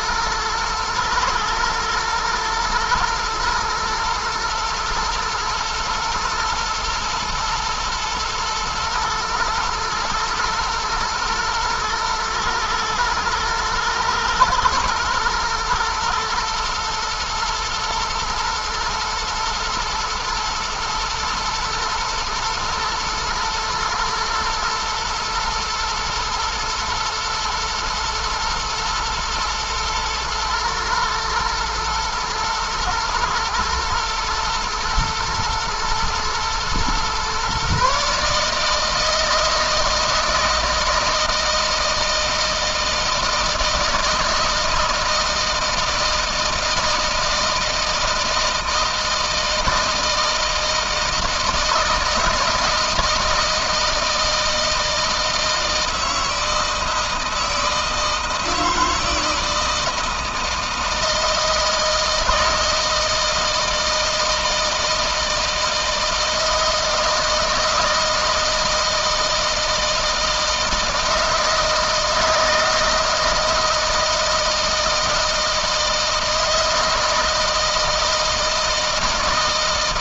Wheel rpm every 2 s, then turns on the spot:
110, 110, 110, 120, 110, 110, 110, 120, 110, 110, 120, 110, 110, 120, 110, 120, 120, 110, 120, 160, 160, 160, 160, 160, 160, 160, 160, 160, 160, 160, 160, 160, 160, 160, 160, 160, 160, 160, 160, 160.
none